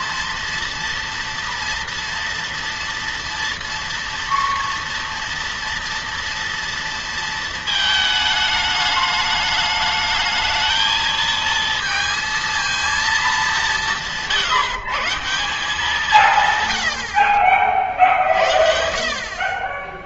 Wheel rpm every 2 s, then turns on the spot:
230, 230, 230, 230, 210, 220, 230, 160, 100, 60.
none